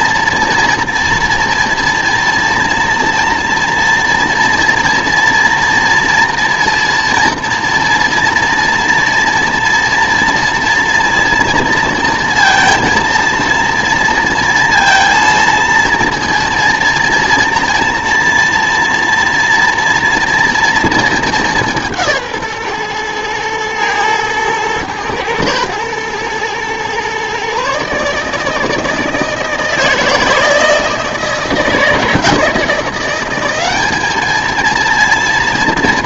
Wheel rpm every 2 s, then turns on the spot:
240, 230, 230, 230, 230, 230, 230, 230, 230, 230, 230, 130, 110, 120, 160, 160, 170, 230.
none